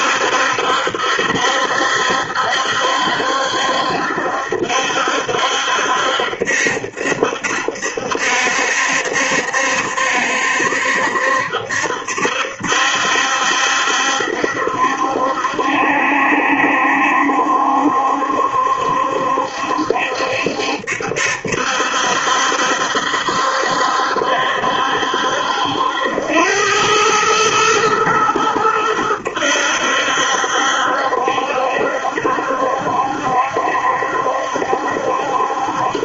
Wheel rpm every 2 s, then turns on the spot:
70, 70, 70, 70, 70, 70, 70, 70, 70, 70, 70, 70, 70, 100, 100, 70, 70, 70.
none